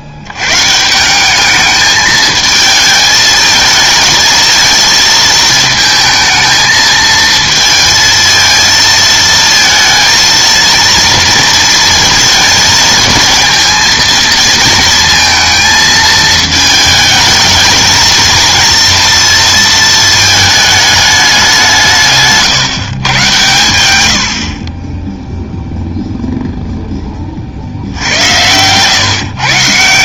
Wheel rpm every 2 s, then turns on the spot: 120, 220, 220, 220, 220, 220, 220, 220, 220, 230, 220, 150, 60, 0, 110.
none